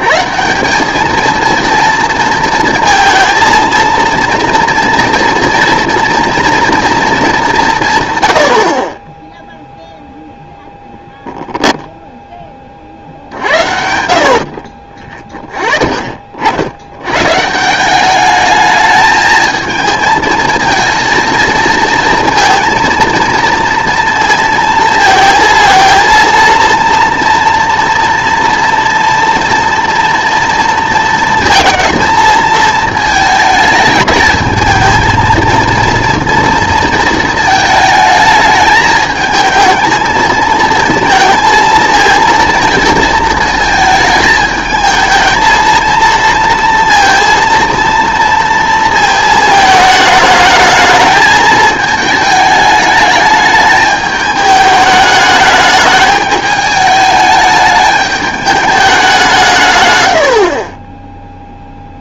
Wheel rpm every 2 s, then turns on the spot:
190, 230, 230, 230, 60, 0, 30, 40, 80, 220, 230, 230, 230, 230, 230, 230, 220, 220, 230, 210, 230, 230, 220, 230, 230, 210, 220, 210, 210, 210, 10.
14-16